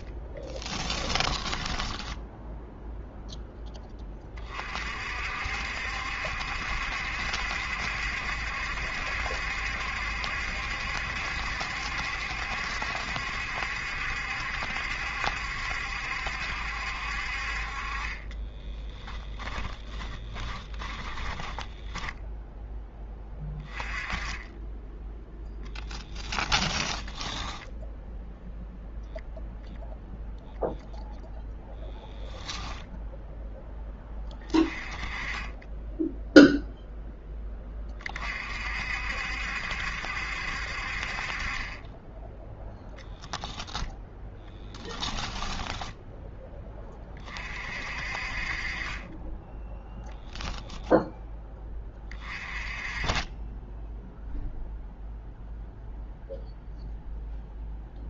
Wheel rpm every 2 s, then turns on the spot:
10, 0, 30, 70, 70, 70, 70, 70, 70, 20, 20, 10, 10, 20, 0, 0, 0, 20, 0, 40, 60, 10, 10, 10, 40, 0, 30, 0, 0.
0-2 18-22 26-28 44-46